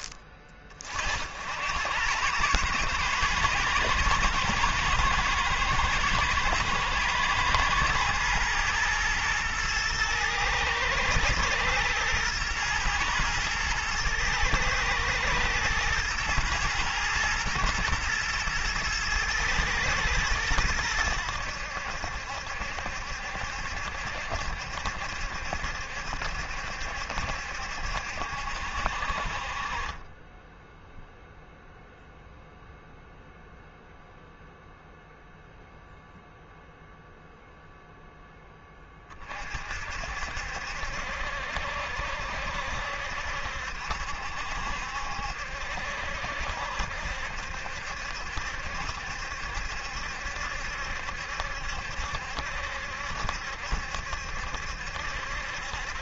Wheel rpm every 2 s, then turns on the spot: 40, 120, 110, 120, 120, 110, 120, 110, 110, 110, 100, 70, 70, 70, 60, 10, 0, 0, 0, 20, 60, 70, 70, 60, 70, 70, 70, 70.
none